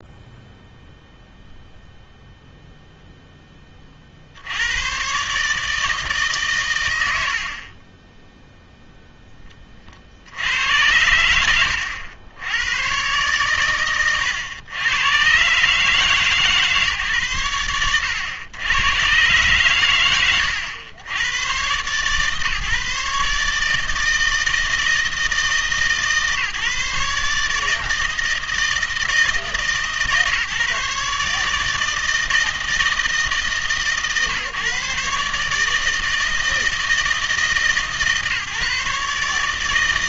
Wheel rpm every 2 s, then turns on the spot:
0, 0, 90, 120, 0, 80, 100, 110, 140, 100, 100, 150, 160, 150, 160, 150, 160, 140, 160, 150.
none